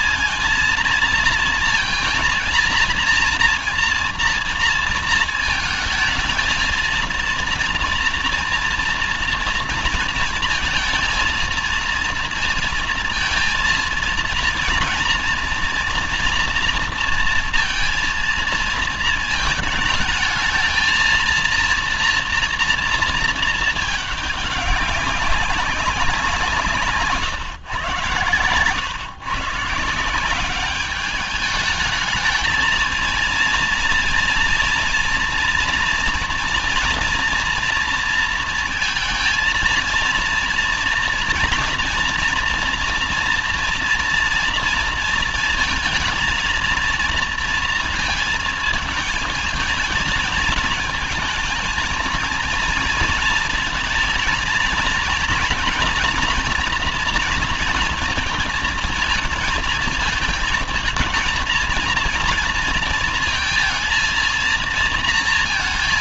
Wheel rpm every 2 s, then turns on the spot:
230, 230, 230, 230, 230, 230, 230, 230, 230, 220, 230, 230, 200, 150, 140, 210, 230, 230, 240, 230, 230, 230, 230, 230, 220, 220, 230, 220, 240, 220, 230, 230, 230.
none